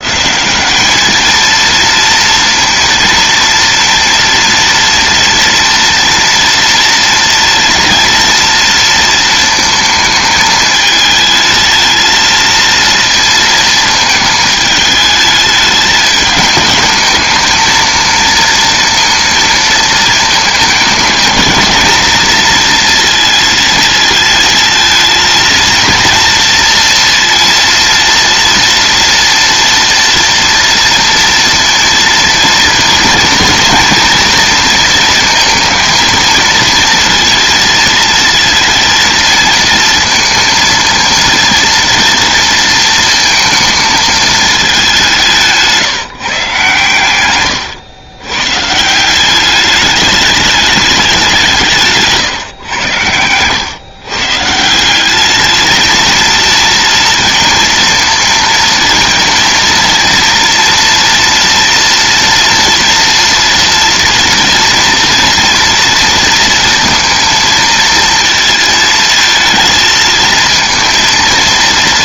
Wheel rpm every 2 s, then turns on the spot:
200, 230, 230, 230, 230, 220, 230, 220, 210, 230, 220, 230, 230, 230, 230, 230, 230, 230, 230, 230, 230, 230, 200, 140, 150, 210, 120, 160, 230, 230, 230, 230, 230, 230, 230, 230.
none